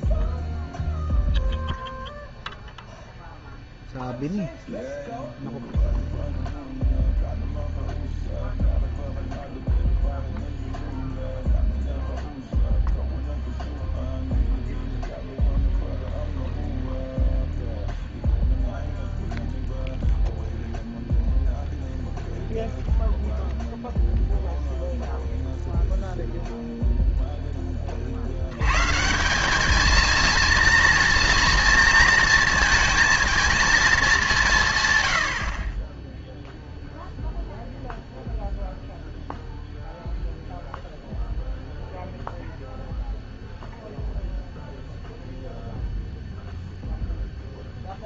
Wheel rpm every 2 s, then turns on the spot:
0, 0, 0, 0, 0, 0, 0, 0, 0, 0, 0, 0, 0, 0, 110, 230, 230, 150, 0, 0, 0, 0, 0, 0.
none